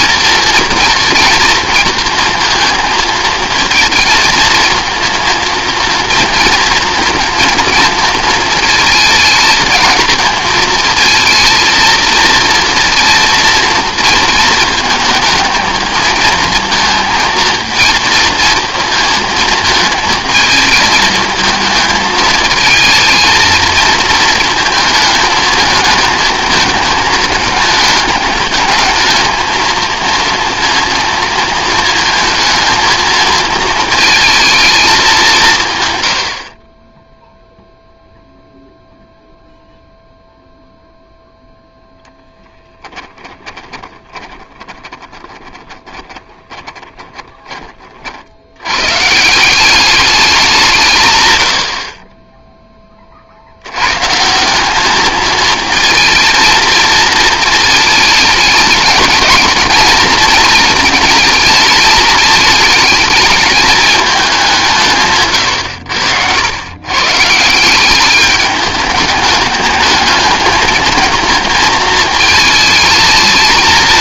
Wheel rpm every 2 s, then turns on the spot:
230, 230, 230, 230, 220, 230, 230, 220, 230, 230, 220, 230, 220, 220, 220, 230, 220, 200, 10, 0, 0, 10, 20, 20, 90, 180, 10, 190, 220, 220, 220, 220, 180, 110, 210, 220, 220.
42-48